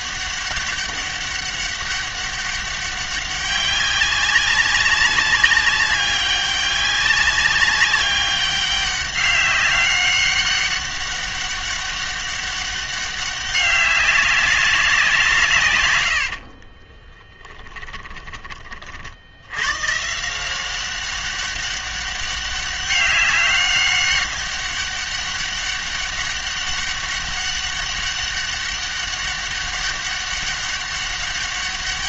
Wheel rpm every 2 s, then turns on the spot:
200, 200, 200, 200, 190, 200, 200, 200, 40, 30, 180, 200, 200, 200, 200, 200.
16-18